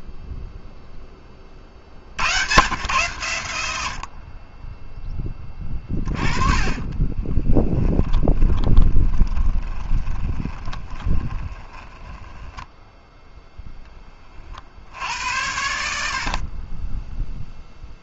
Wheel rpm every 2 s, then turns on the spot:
20, 110, 10, 20, 20, 20, 10, 50, 20.
6-14